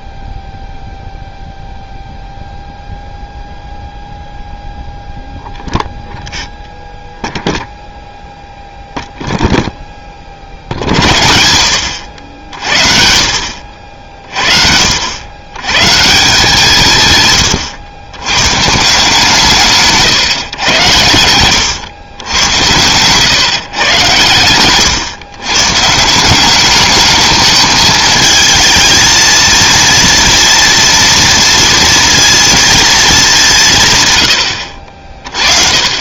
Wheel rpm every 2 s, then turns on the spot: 0, 0, 0, 0, 0, 60, 50, 60, 160, 150, 110, 110, 120, 210, 220, 230, 220, 60.
none